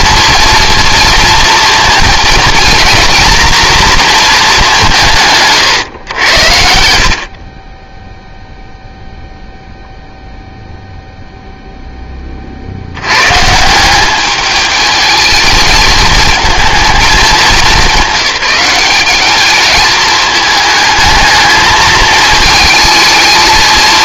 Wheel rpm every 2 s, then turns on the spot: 230, 230, 180, 60, 0, 0, 80, 220, 220, 200, 220, 220.
none